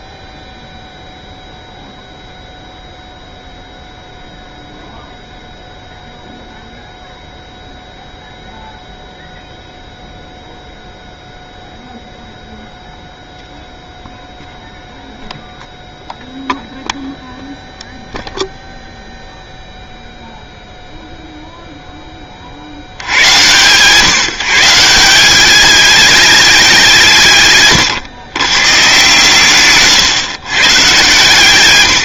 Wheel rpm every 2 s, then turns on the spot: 0, 0, 0, 0, 0, 0, 0, 0, 0, 0, 0, 60, 160, 190, 120, 130.
none